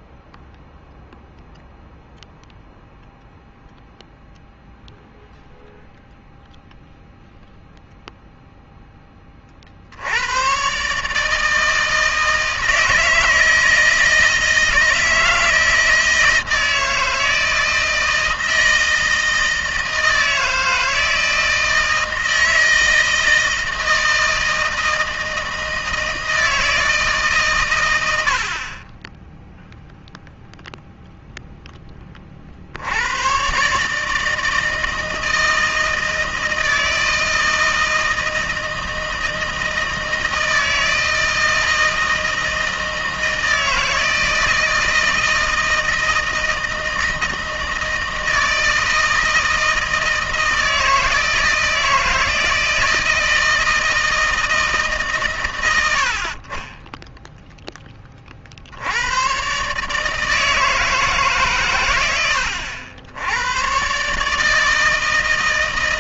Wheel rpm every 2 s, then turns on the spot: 0, 0, 0, 0, 0, 100, 160, 160, 160, 160, 160, 160, 160, 160, 50, 0, 40, 160, 160, 160, 160, 160, 160, 160, 160, 160, 160, 150, 40, 50, 160, 90, 150.
none